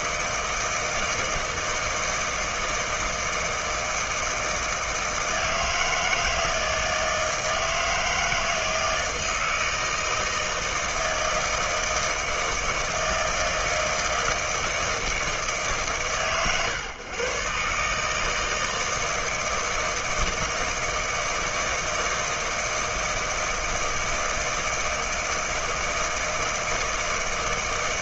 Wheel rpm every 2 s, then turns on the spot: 160, 160, 160, 160, 160, 160, 160, 160, 120, 160, 160, 160, 160, 160.
none